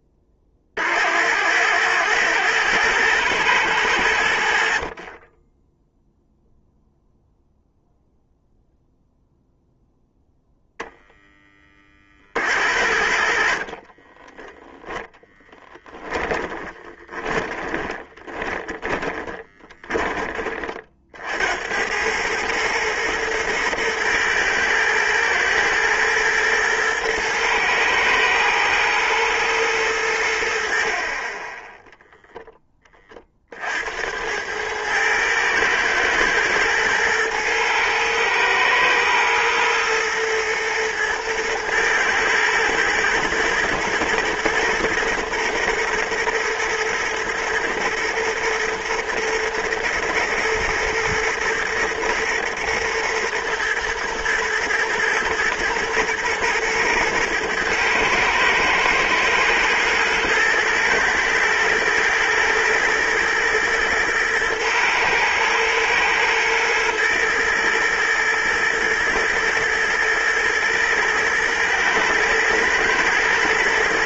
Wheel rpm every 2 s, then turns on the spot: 40, 110, 70, 0, 0, 0, 50, 10, 20, 20, 30, 110, 110, 110, 110, 70, 10, 90, 120, 120, 120, 110, 120, 120, 120, 110, 110, 120, 120, 110, 110, 110, 110, 110, 120, 110, 120.
14-20